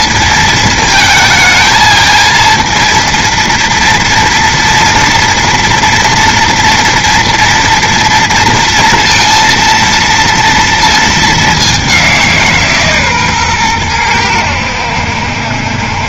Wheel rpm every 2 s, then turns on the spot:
230, 230, 230, 230, 230, 230, 160, 90.
none